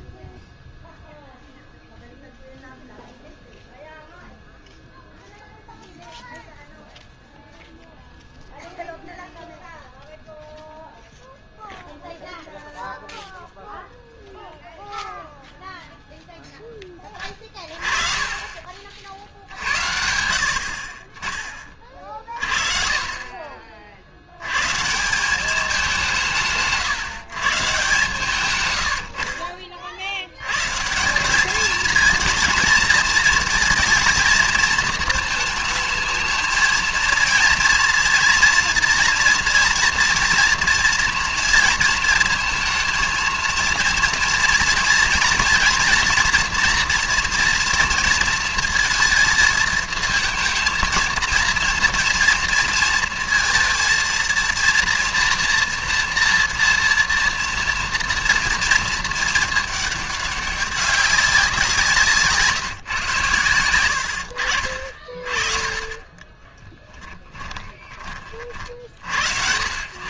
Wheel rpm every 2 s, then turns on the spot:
0, 0, 0, 0, 0, 0, 0, 0, 10, 50, 60, 40, 120, 150, 110, 120, 230, 220, 220, 230, 230, 230, 230, 230, 230, 230, 230, 230, 230, 230, 200, 140, 40, 10, 50.
66-68